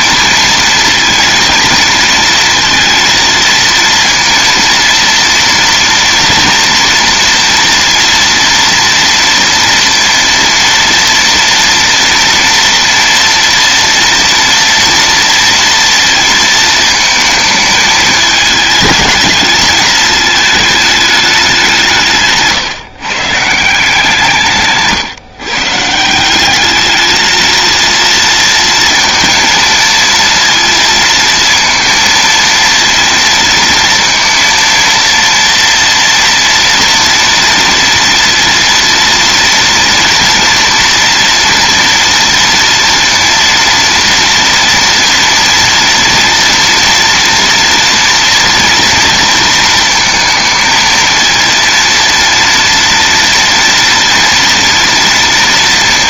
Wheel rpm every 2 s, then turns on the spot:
230, 230, 230, 230, 230, 230, 230, 230, 220, 210, 220, 150, 150, 190, 230, 230, 230, 230, 230, 230, 230, 230, 230, 230, 240, 220, 230, 230.
none